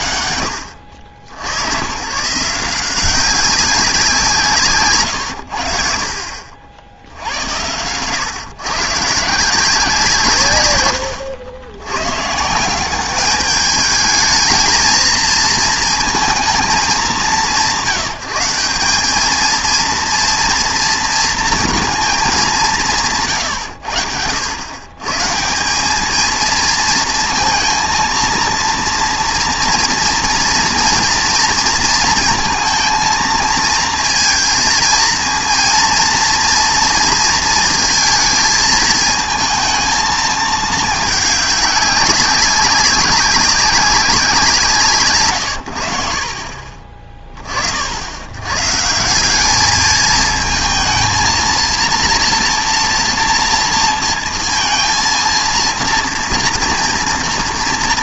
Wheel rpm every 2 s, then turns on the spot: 70, 160, 150, 70, 130, 130, 150, 220, 220, 180, 230, 200, 100, 220, 230, 230, 230, 230, 230, 220, 220, 200, 170, 40, 130, 230, 230, 230, 230.
none